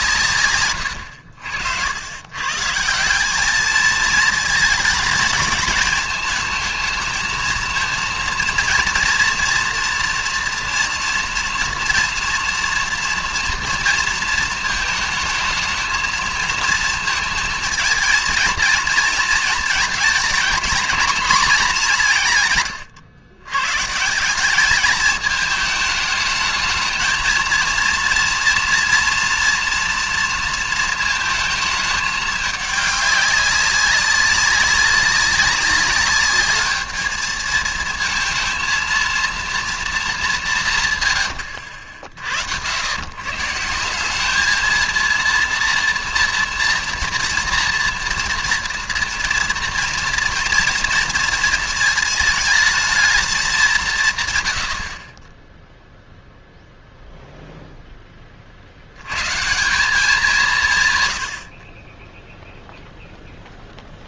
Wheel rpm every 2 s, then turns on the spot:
120, 150, 210, 220, 230, 230, 230, 220, 220, 230, 230, 130, 200, 220, 230, 230, 210, 190, 210, 230, 160, 90, 220, 240, 230, 230, 220, 90, 0, 60, 150, 0.
none